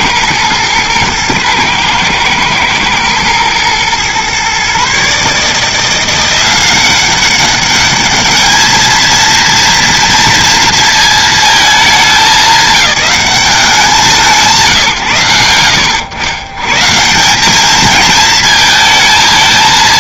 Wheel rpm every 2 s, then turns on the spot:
110, 110, 130, 180, 220, 230, 210, 160, 130, 230.
none